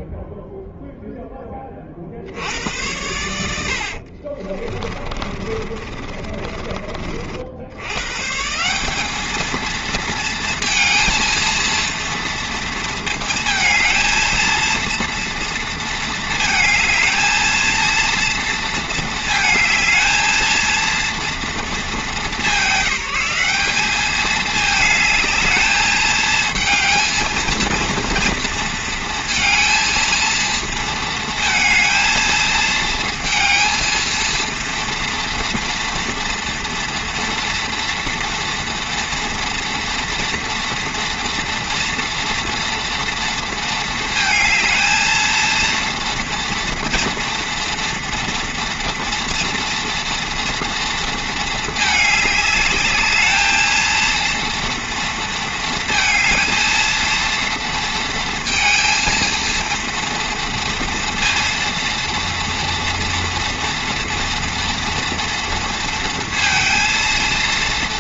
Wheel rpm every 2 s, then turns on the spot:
0, 80, 30, 30, 180, 230, 230, 230, 220, 220, 230, 180, 220, 230, 230, 230, 220, 230, 230, 240, 230, 240, 220, 230, 230, 230, 210, 230, 230, 230, 230, 230, 230, 230.
4-6